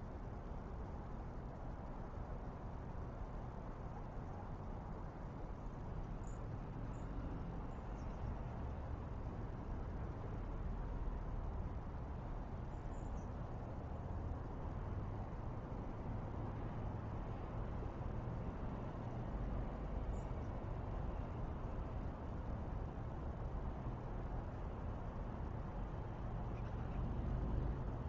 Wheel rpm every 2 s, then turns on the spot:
0, 0, 0, 0, 0, 0, 0, 0, 0, 0, 0, 0, 0, 0.
none